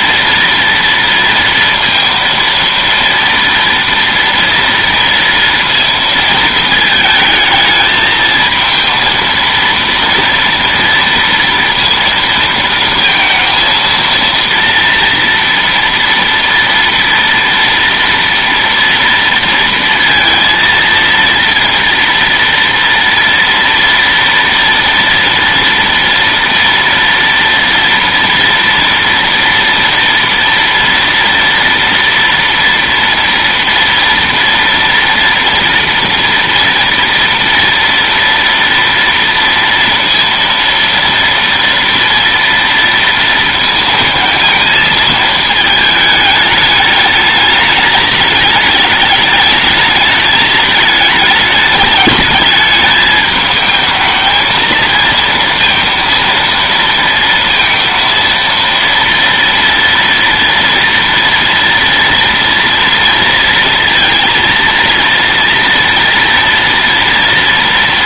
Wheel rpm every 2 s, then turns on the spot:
230, 230, 230, 220, 230, 230, 230, 230, 230, 230, 230, 230, 230, 230, 230, 230, 230, 230, 230, 230, 230, 230, 230, 210, 210, 210, 210, 230, 230, 230, 230, 240, 230, 230.
none